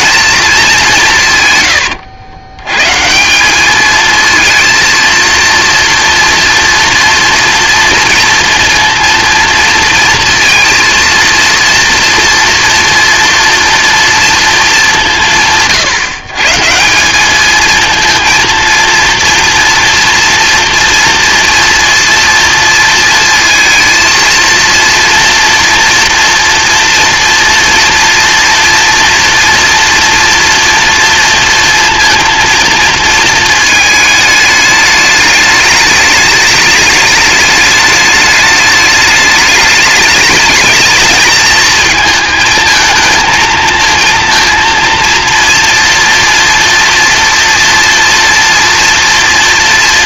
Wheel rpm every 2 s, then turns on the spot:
200, 110, 230, 240, 230, 230, 240, 220, 160, 230, 230, 230, 230, 230, 230, 230, 230, 210, 210, 210, 210, 220, 230, 230, 230.
none